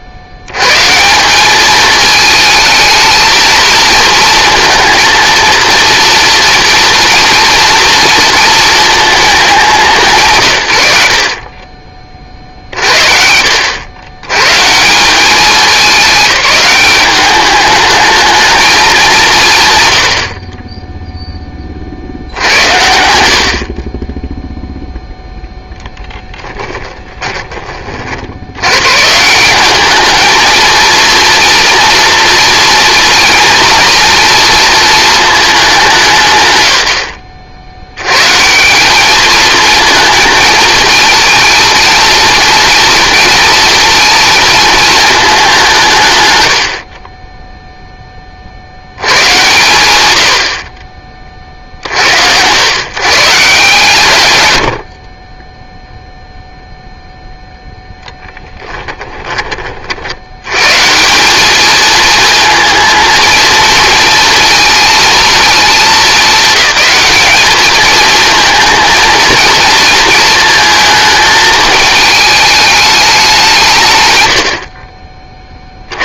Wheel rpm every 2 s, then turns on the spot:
70, 220, 230, 230, 220, 110, 50, 160, 200, 210, 20, 90, 0, 10, 100, 220, 240, 230, 120, 160, 220, 230, 220, 40, 100, 50, 110, 70, 0, 10, 140, 220, 230, 200, 230, 220, 210, 40.
26-28 74-76